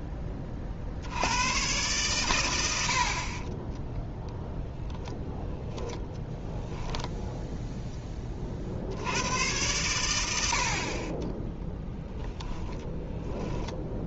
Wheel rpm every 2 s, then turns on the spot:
30, 100, 0, 0, 40, 70, 10.
none